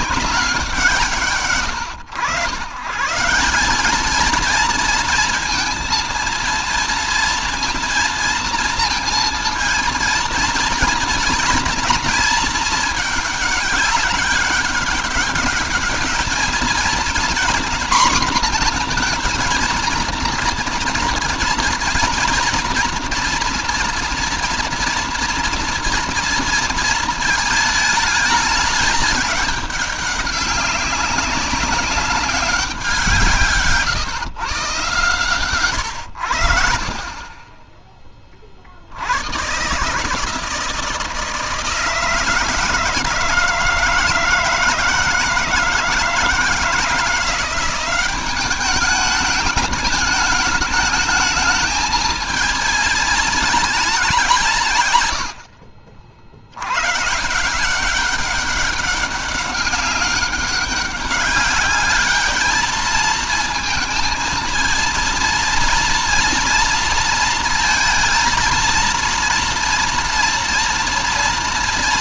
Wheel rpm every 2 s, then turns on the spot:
190, 130, 230, 230, 230, 230, 220, 210, 230, 240, 230, 230, 230, 230, 220, 200, 180, 120, 50, 70, 160, 160, 160, 160, 200, 210, 220, 150, 120, 200, 200, 220, 230, 230, 230, 230.
none